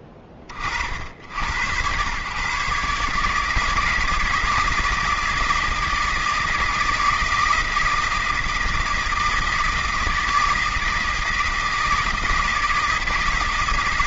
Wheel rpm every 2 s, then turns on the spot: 30, 130, 160, 160, 160, 160, 160.
none